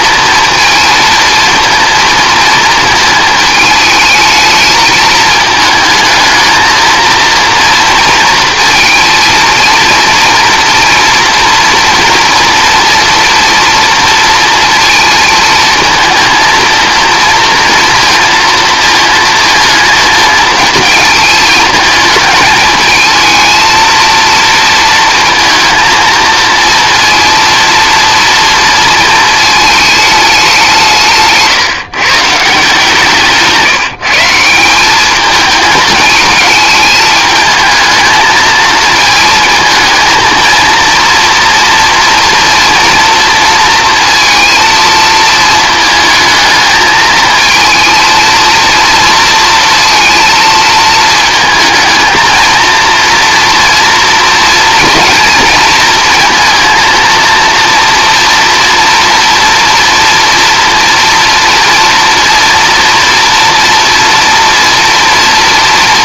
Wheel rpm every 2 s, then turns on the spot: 220, 230, 220, 220, 230, 230, 230, 230, 230, 230, 220, 220, 230, 230, 230, 190, 160, 190, 210, 220, 230, 230, 230, 220, 230, 220, 230, 230, 230, 230, 230, 230, 240.
none